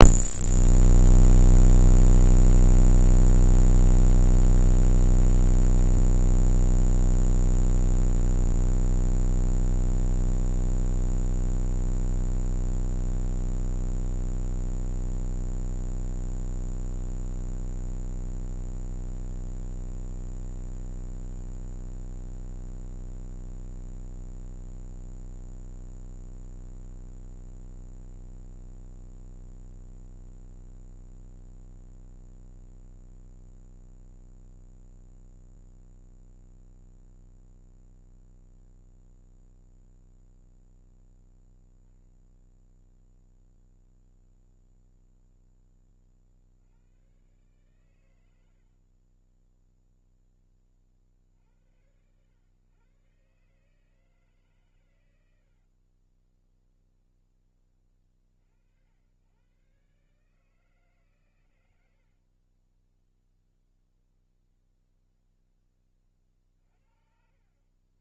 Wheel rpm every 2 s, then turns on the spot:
0, 0, 0, 0, 60, 30, 100, 10, 10, 100, 120, 10, 0, 10, 20, 20, 10, 0, 10, 20, 10, 0, 20, 110, 30, 60, 140, 100, 30, 90, 130, 10, 0, 40.
16-18 26-34 36-40 44-46 48-50 54-56 62-64